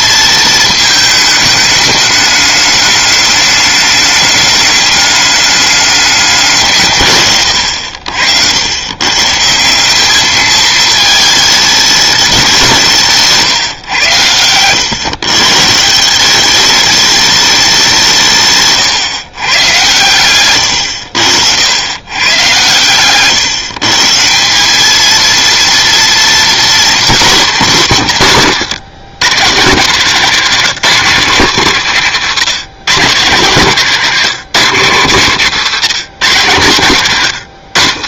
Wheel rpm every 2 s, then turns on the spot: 220, 210, 210, 160, 90, 210, 180, 100, 200, 140, 110, 120, 190, 220, 140, 190, 160, 170, 140.
18-22 28-30